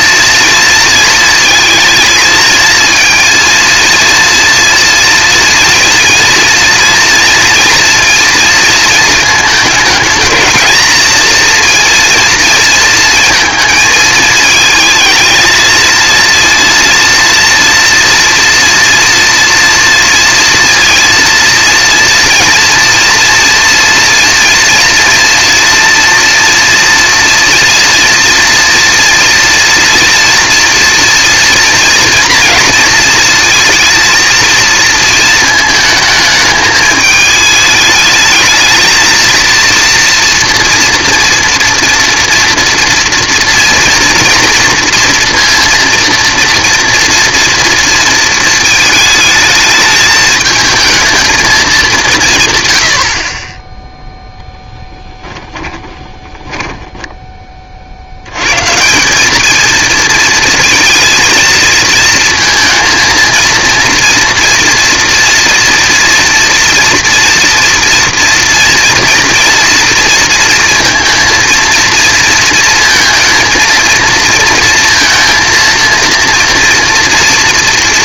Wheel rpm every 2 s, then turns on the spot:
230, 220, 230, 230, 230, 220, 230, 220, 230, 240, 230, 230, 230, 230, 230, 240, 230, 230, 220, 220, 230, 230, 230, 230, 220, 220, 140, 10, 10, 130, 230, 230, 230, 240, 230, 230, 230, 230, 230.
54-58